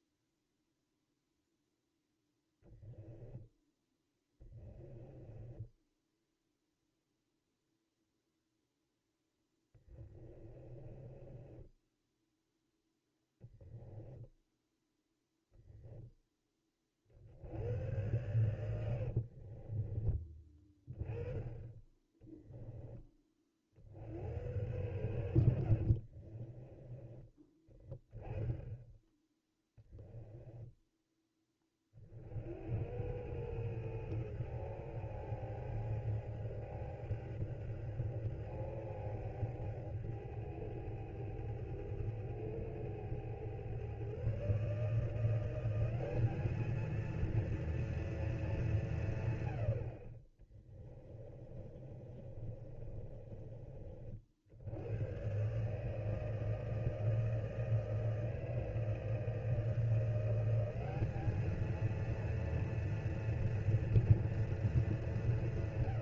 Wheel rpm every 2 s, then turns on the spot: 0, 0, 10, 0, 0, 20, 0, 0, 40, 80, 10, 20, 100, 20, 10, 10, 90, 110, 100, 100, 100, 110, 160, 230, 180, 20, 30, 100, 160, 160, 200, 230, 200.
4-6 10-12 18-20 26-28 50-54